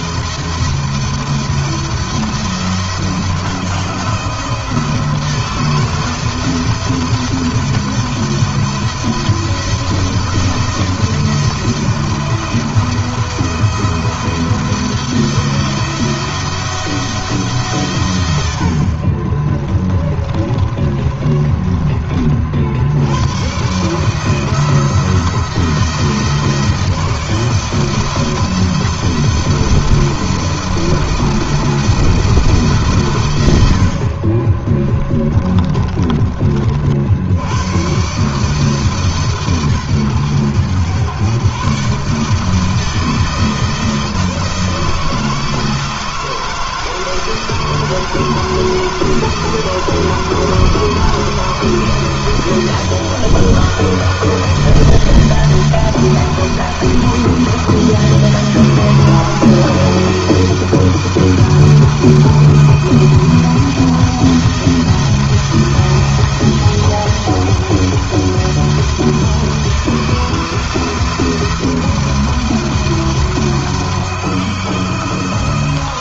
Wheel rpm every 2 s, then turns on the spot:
170, 170, 170, 170, 170, 160, 160, 170, 160, 50, 30, 100, 170, 160, 170, 170, 130, 30, 60, 150, 120, 160, 160, 160, 160, 160, 170, 170, 170, 170, 160, 160, 160, 170, 160, 160, 170, 160.
18-22 34-36